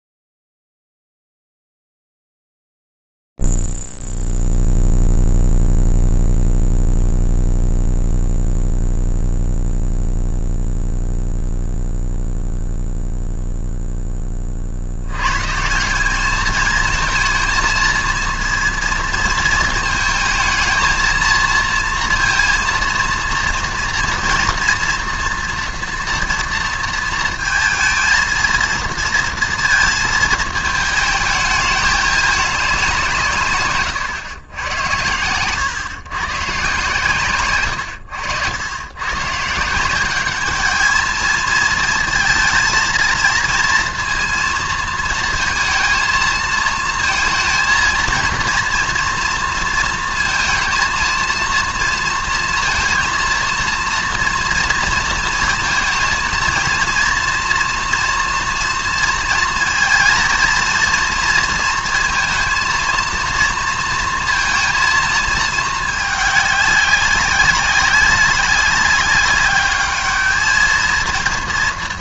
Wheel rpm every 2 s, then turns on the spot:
0, 0, 0, 0, 0, 0, 0, 30, 220, 230, 220, 230, 240, 230, 230, 230, 210, 110, 140, 90, 210, 230, 230, 230, 230, 230, 230, 230, 230, 240, 230, 230, 230, 200, 200, 220.
none